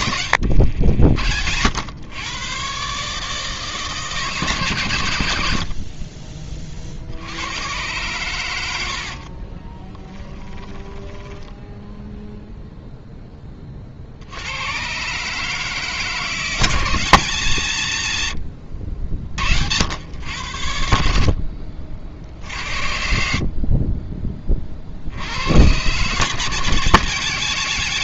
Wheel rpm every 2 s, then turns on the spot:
70, 130, 130, 60, 60, 10, 30, 150, 130, 60, 50, 40, 100, 150.
8-12